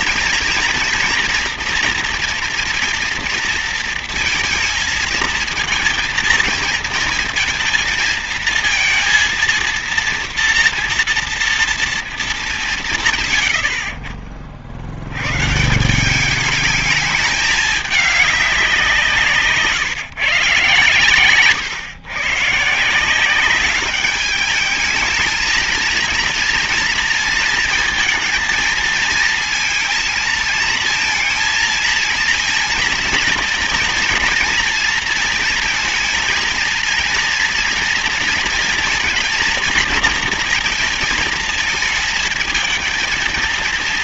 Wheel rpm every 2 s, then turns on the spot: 240, 230, 230, 230, 230, 230, 180, 50, 210, 200, 130, 140, 210, 230, 220, 220, 230, 230, 230, 230, 230, 220.
none